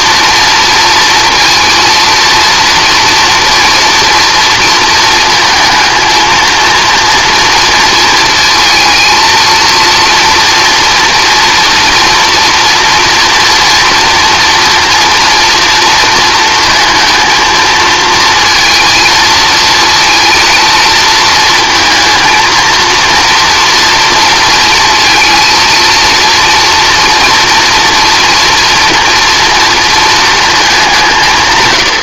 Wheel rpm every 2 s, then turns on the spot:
230, 230, 230, 230, 230, 230, 230, 230, 230, 230, 230, 230, 230, 230, 230, 210.
none